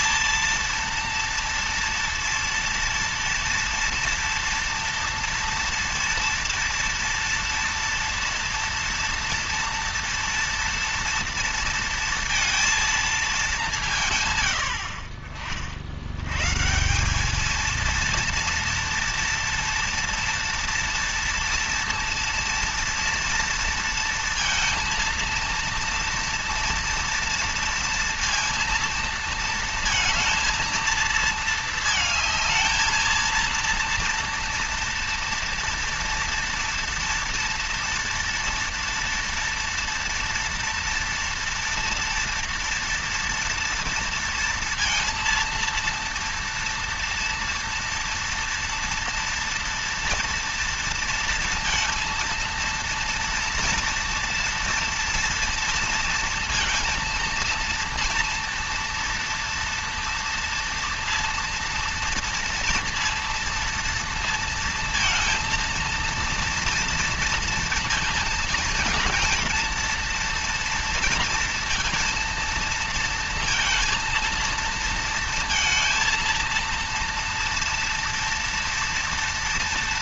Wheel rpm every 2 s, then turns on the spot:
230, 230, 230, 230, 230, 230, 230, 80, 150, 230, 230, 230, 230, 230, 230, 230, 220, 230, 230, 230, 230, 230, 230, 230, 230, 230, 230, 230, 230, 230, 230, 240, 230, 230, 230, 230, 230, 230, 230, 230.
none